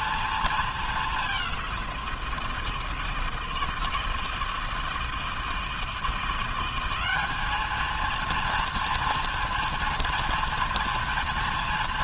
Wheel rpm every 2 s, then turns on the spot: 210, 160, 160, 190, 230, 240.
none